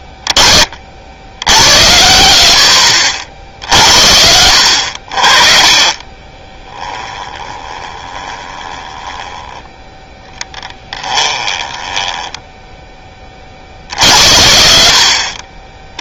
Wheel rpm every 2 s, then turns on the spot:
20, 40, 40, 10, 10, 10, 0, 30.
none